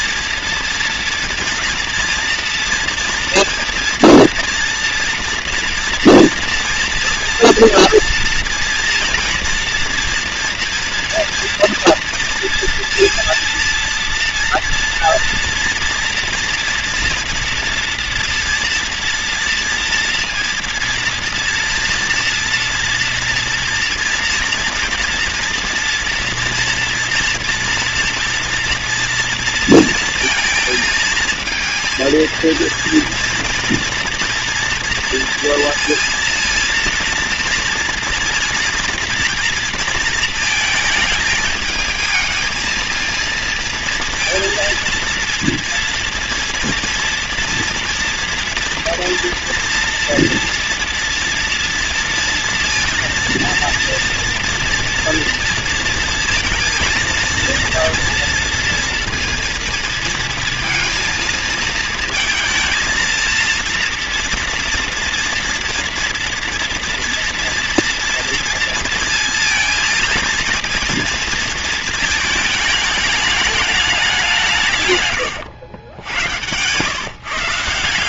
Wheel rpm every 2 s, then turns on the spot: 230, 230, 230, 230, 230, 230, 240, 230, 240, 230, 230, 230, 230, 230, 230, 230, 230, 230, 230, 240, 220, 220, 230, 230, 230, 230, 230, 240, 230, 230, 230, 220, 230, 230, 230, 230, 220, 150, 120.
none